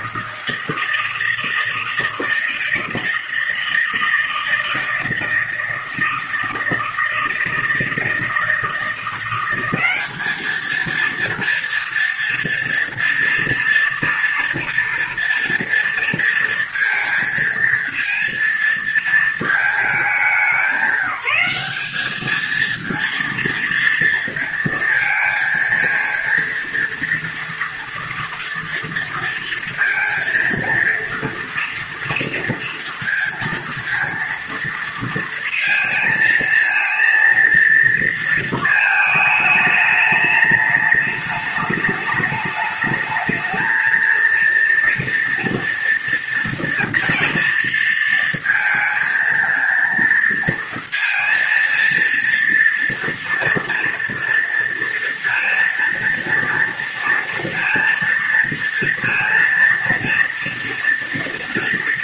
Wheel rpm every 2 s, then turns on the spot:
160, 160, 160, 160, 160, 220, 230, 230, 230, 230, 190, 220, 230, 230, 230, 230, 240, 230, 230, 220, 210, 210, 230, 230, 230, 230, 230, 230, 230, 230, 240.
none